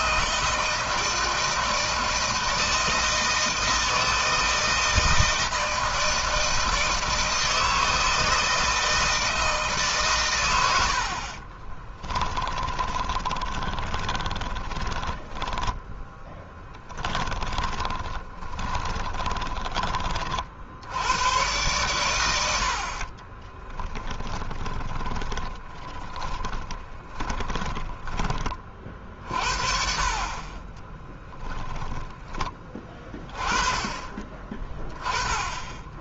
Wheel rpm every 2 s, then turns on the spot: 160, 160, 160, 160, 160, 80, 20, 10, 10, 20, 80, 40, 20, 20, 40, 10, 20, 10.
10-20 22-28 30-32